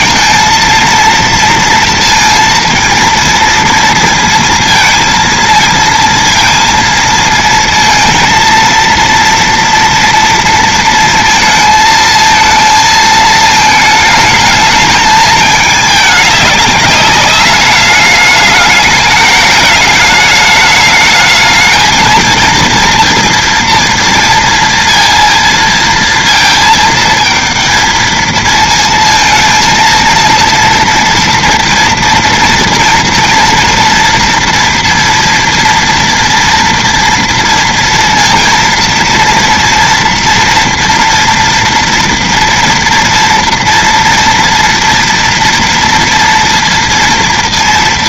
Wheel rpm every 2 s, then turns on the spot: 230, 230, 230, 230, 230, 230, 220, 220, 200, 210, 210, 230, 230, 220, 220, 230, 240, 230, 230, 230, 230, 230, 230, 230.
none